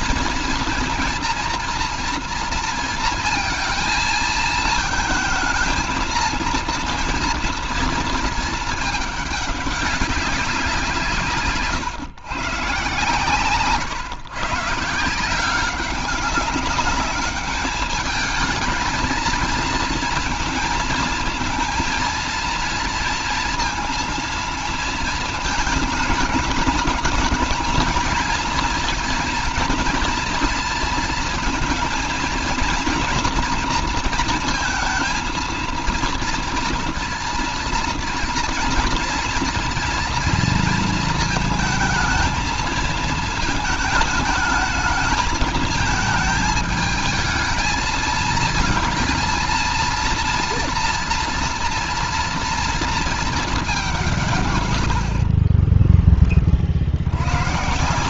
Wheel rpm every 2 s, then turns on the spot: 230, 230, 220, 230, 220, 190, 130, 150, 200, 220, 230, 230, 230, 220, 220, 230, 230, 230, 230, 230, 230, 220, 210, 220, 220, 230, 230, 140, 20.
none